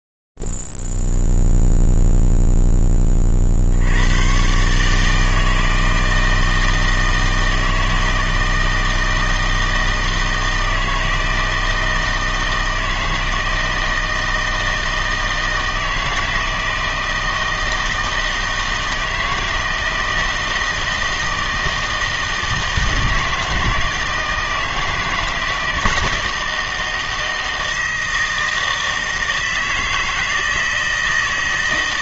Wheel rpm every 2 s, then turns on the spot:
0, 0, 80, 160, 160, 160, 160, 160, 160, 160, 160, 160, 160, 160, 160, 160.
none